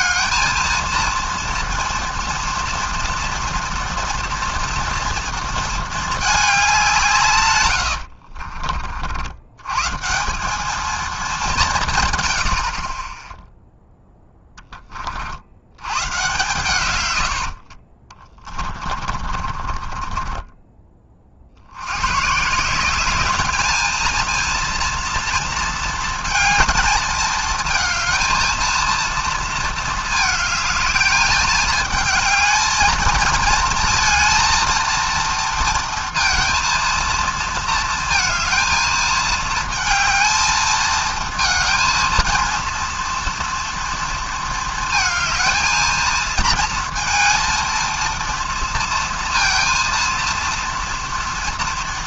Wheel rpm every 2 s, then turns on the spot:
230, 230, 230, 200, 50, 210, 50, 10, 120, 20, 20, 170, 230, 220, 220, 220, 220, 230, 230, 230, 220, 230, 220, 230, 230, 230.
8-10 18-20